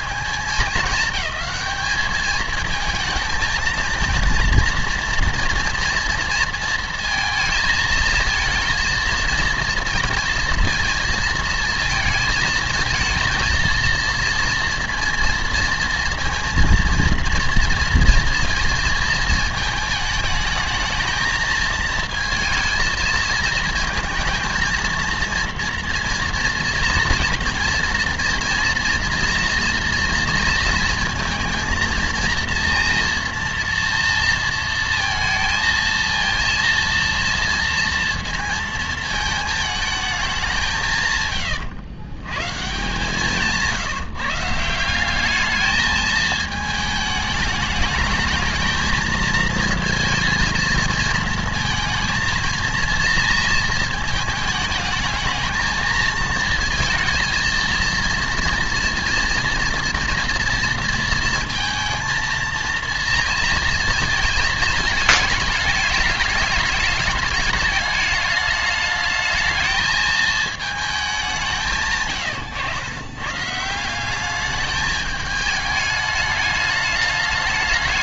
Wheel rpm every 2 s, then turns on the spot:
210, 220, 230, 230, 230, 230, 220, 230, 230, 230, 220, 230, 230, 230, 230, 230, 230, 230, 230, 230, 180, 130, 170, 220, 220, 220, 230, 220, 230, 230, 230, 230, 220, 210, 210, 220, 110, 210, 210.
none